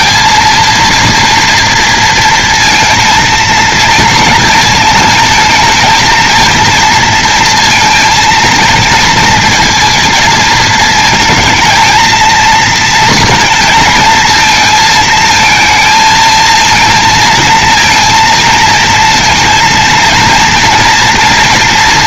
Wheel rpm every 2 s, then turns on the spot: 230, 230, 230, 230, 230, 220, 230, 220, 230, 230, 230.
none